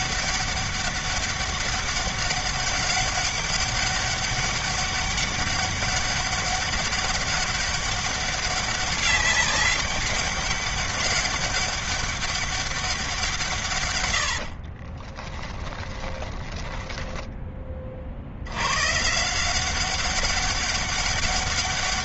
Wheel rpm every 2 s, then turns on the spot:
200, 200, 200, 200, 200, 200, 190, 40, 10, 130, 200.
14-16